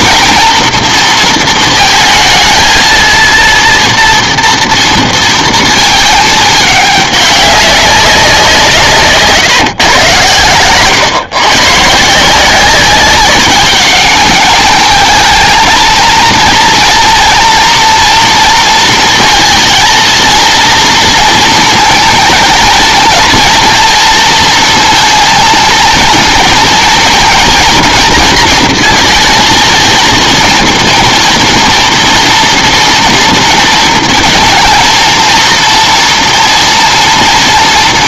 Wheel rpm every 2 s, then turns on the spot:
230, 230, 230, 210, 150, 130, 190, 210, 230, 230, 230, 230, 230, 230, 230, 230, 240, 230, 230.
none